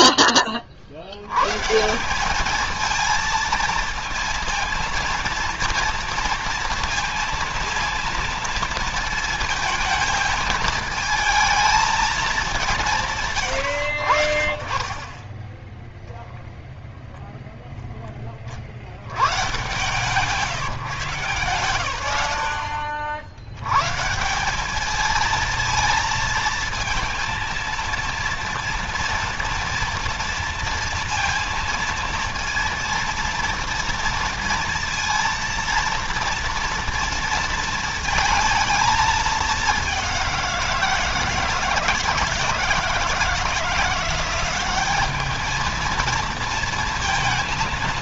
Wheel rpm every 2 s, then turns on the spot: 30, 210, 230, 230, 230, 220, 200, 60, 0, 40, 160, 80, 180, 230, 230, 230, 230, 230, 230, 230, 180, 160, 190, 230.
none